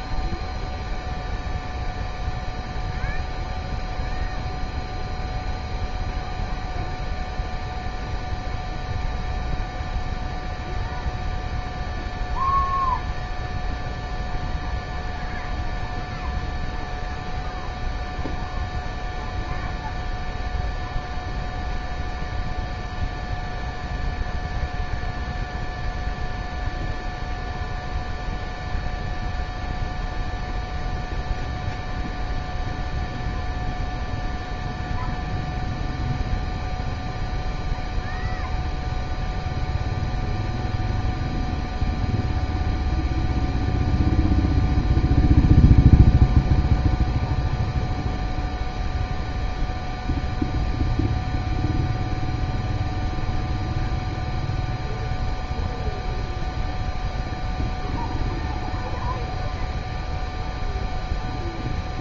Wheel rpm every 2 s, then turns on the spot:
0, 0, 0, 0, 0, 0, 0, 0, 0, 0, 0, 0, 0, 0, 0, 0, 0, 0, 0, 0, 0, 0, 0, 0, 0, 0, 0, 0, 0, 0, 0.
none